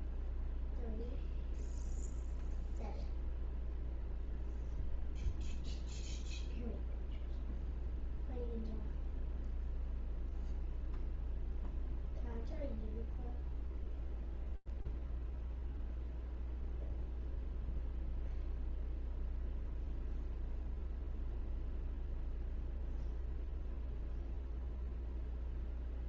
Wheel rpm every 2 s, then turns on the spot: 0, 0, 0, 0, 0, 0, 0, 0, 0, 0, 0, 0, 0.
none